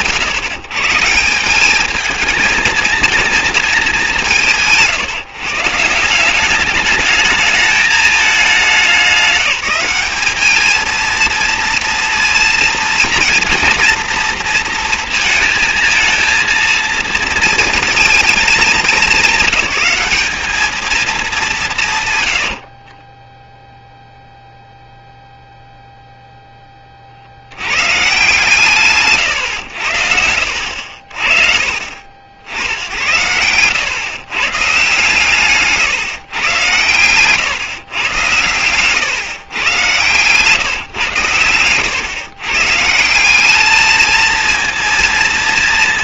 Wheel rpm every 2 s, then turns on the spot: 130, 220, 140, 210, 190, 220, 240, 230, 230, 210, 220, 50, 0, 20, 150, 70, 80, 140, 110, 120, 130, 160, 230.
22-24